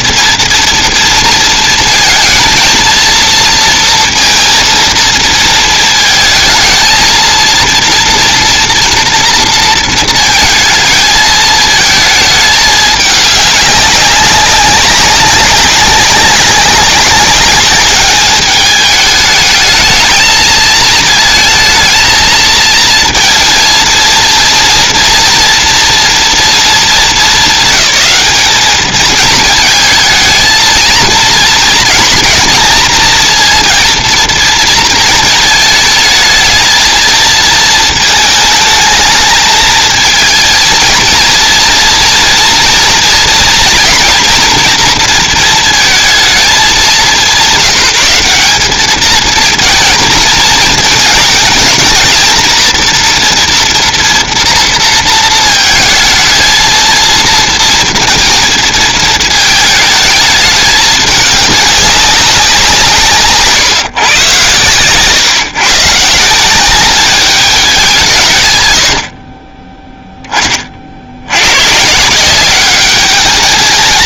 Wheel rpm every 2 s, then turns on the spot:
240, 230, 230, 220, 240, 220, 210, 200, 200, 210, 220, 230, 230, 220, 220, 220, 230, 230, 220, 220, 230, 230, 230, 210, 210, 220, 230, 230, 230, 220, 210, 180, 120, 190, 110, 30, 190.
none